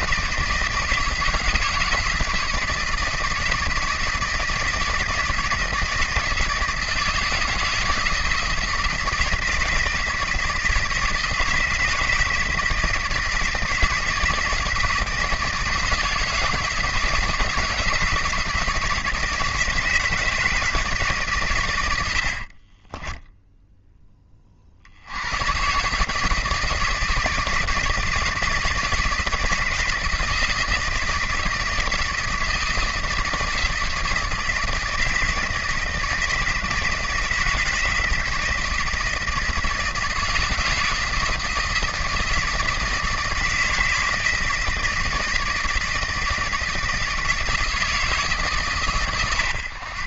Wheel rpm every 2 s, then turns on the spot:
160, 160, 160, 160, 160, 160, 160, 160, 160, 170, 160, 50, 50, 160, 160, 160, 170, 160, 160, 160, 160, 160, 160, 160, 140.
22-24